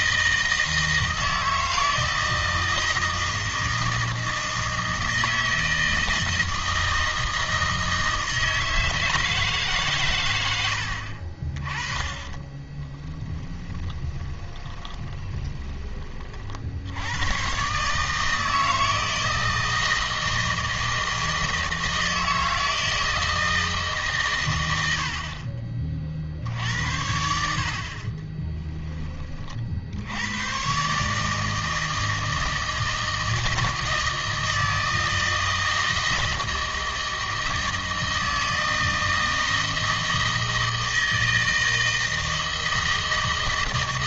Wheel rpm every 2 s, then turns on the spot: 160, 160, 160, 160, 160, 80, 20, 20, 60, 160, 160, 160, 100, 70, 10, 110, 160, 160, 160, 160, 160, 160.
12-16 26-28